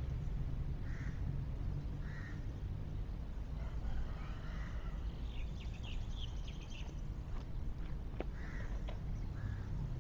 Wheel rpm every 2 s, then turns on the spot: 0, 0, 0, 0, 0.
none